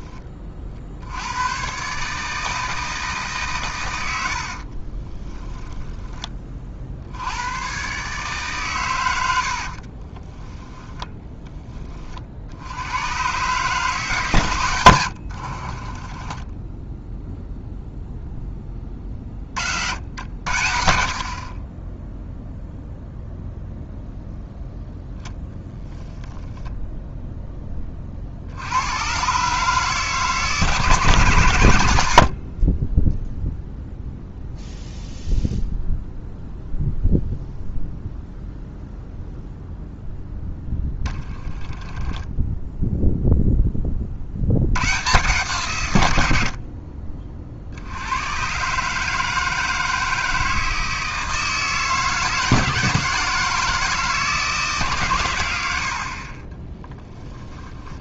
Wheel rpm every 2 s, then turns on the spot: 40, 160, 40, 60, 120, 10, 90, 100, 10, 20, 70, 0, 0, 10, 90, 150, 30, 0, 0, 0, 10, 0, 100, 50, 140, 160, 160, 140, 10.
4-6 16-18 20-22 32-34 40-42 56-58